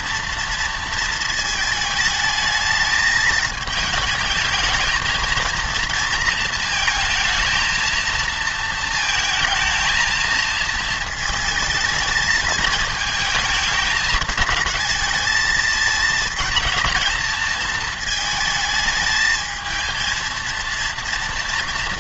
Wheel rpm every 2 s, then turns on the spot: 230, 220, 220, 220, 230, 230, 220, 220, 230, 220, 230.
none